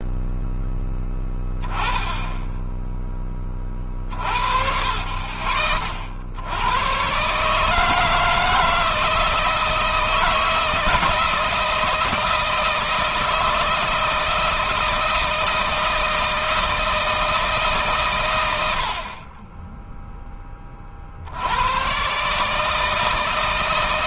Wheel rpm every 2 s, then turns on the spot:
10, 10, 50, 90, 160, 160, 160, 160, 160, 80, 20, 150.
none